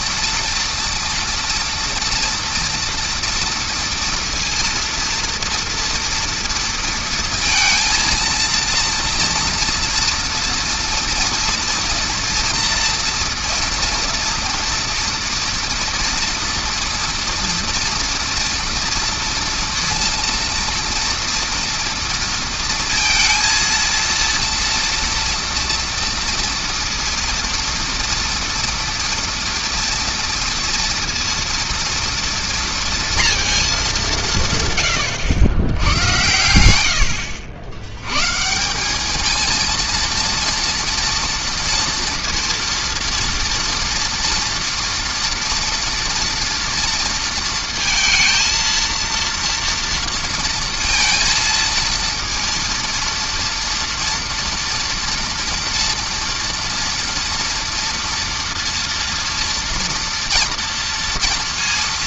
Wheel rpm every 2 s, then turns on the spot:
230, 230, 230, 230, 230, 230, 240, 230, 240, 230, 230, 230, 230, 230, 230, 230, 230, 140, 90, 190, 230, 230, 230, 230, 230, 230, 230, 230, 240, 230, 230.
none